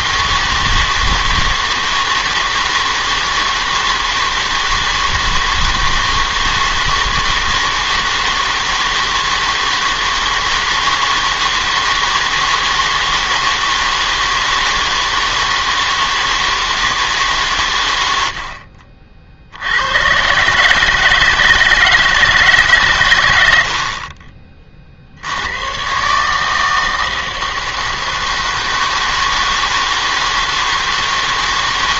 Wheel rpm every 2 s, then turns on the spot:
160, 160, 160, 160, 160, 160, 160, 160, 160, 60, 140, 150, 30, 160, 160, 160.
none